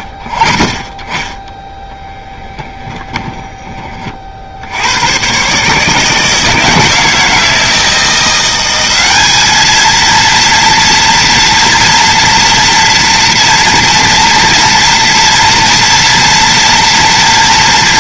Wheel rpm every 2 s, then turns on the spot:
20, 10, 80, 160, 190, 230, 240, 230, 230.
2-4